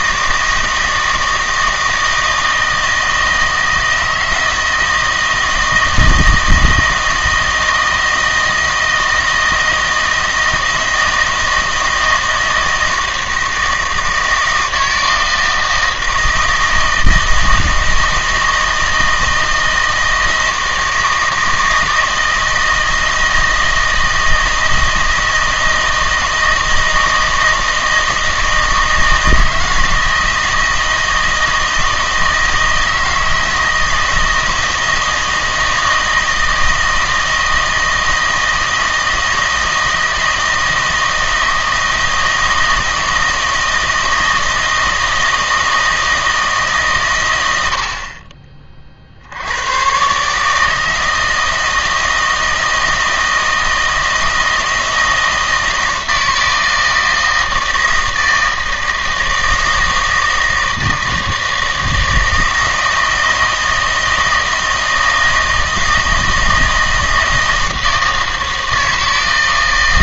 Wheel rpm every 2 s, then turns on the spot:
160, 160, 160, 160, 160, 160, 160, 160, 160, 160, 160, 160, 160, 160, 160, 160, 160, 160, 160, 160, 160, 160, 160, 150, 30, 150, 160, 160, 160, 160, 160, 160, 160, 160, 160.
none